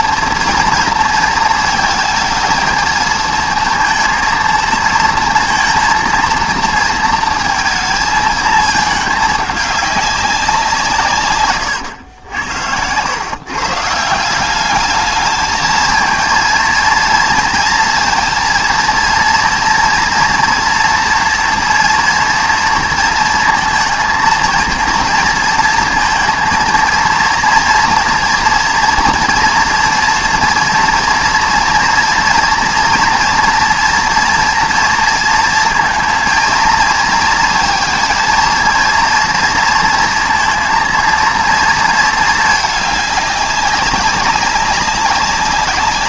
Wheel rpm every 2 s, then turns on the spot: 230, 220, 230, 230, 220, 170, 90, 200, 230, 230, 230, 230, 230, 230, 230, 230, 230, 240, 230, 230, 230, 210, 200.
none